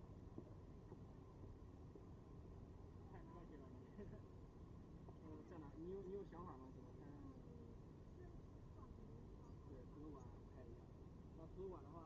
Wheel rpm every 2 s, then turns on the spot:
0, 0, 0, 0, 0, 0.
none